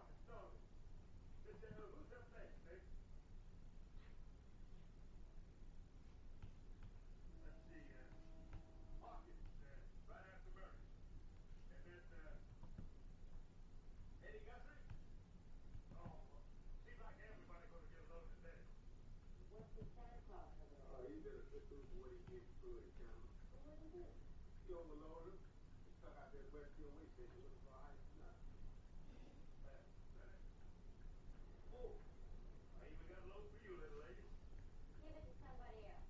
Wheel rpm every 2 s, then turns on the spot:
0, 0, 0, 0, 0, 0, 0, 0, 0, 0, 0, 0, 0, 0, 0, 0, 0, 0.
none